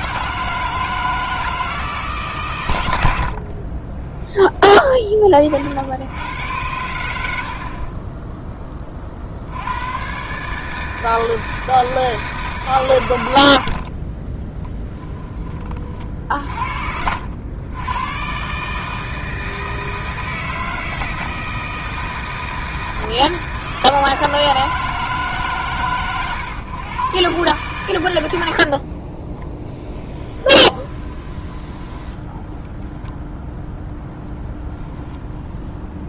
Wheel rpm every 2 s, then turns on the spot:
160, 110, 20, 100, 20, 150, 140, 10, 50, 140, 160, 160, 160, 120, 60, 20, 0, 0.
14-16 28-32